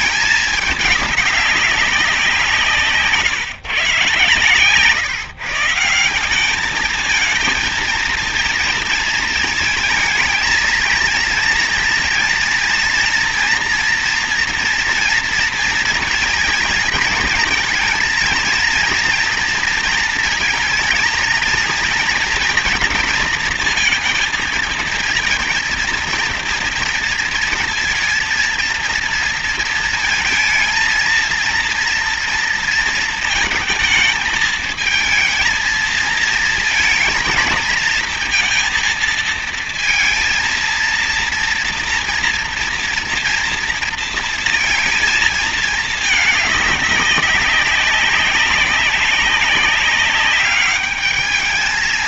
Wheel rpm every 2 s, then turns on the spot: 210, 160, 130, 210, 230, 220, 230, 240, 230, 230, 220, 230, 230, 230, 230, 220, 230, 220, 230, 230, 230, 230, 230, 200, 200, 200.
none